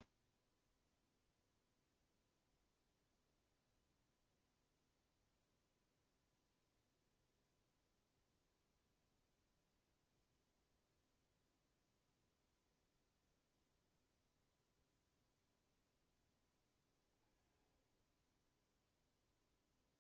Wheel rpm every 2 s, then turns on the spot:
0, 0, 0, 0, 0, 0, 0, 0, 10, 10.
none